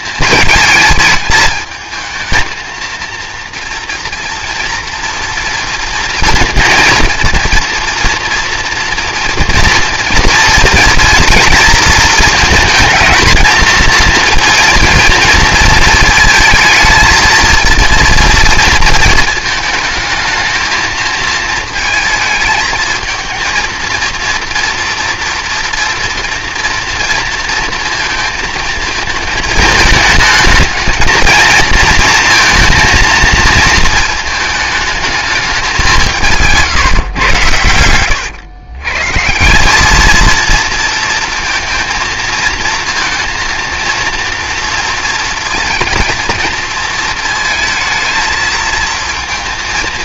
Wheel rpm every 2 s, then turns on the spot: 220, 230, 230, 230, 240, 230, 220, 230, 220, 230, 220, 220, 230, 240, 220, 220, 230, 220, 150, 120, 230, 230, 230, 230, 220.
36-38